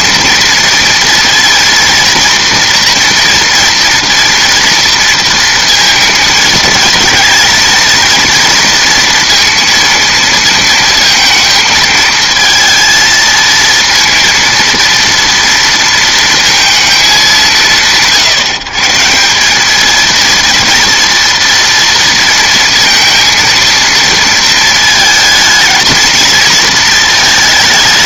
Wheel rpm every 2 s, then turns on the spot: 230, 230, 230, 220, 230, 230, 230, 230, 230, 140, 230, 230, 220, 230.
none